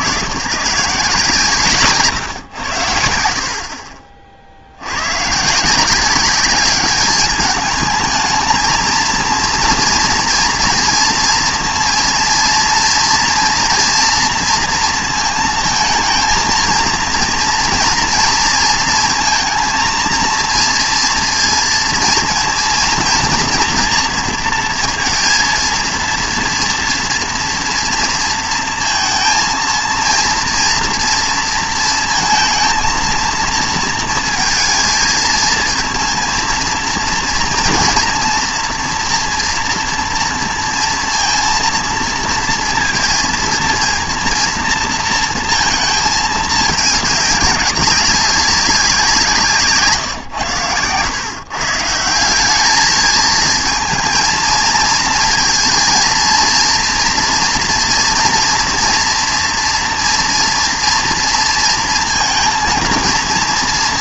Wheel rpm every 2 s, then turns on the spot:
130, 100, 60, 200, 220, 240, 240, 230, 230, 220, 230, 230, 230, 230, 230, 230, 230, 220, 230, 230, 230, 230, 230, 210, 190, 120, 200, 220, 230, 230, 230, 230.
none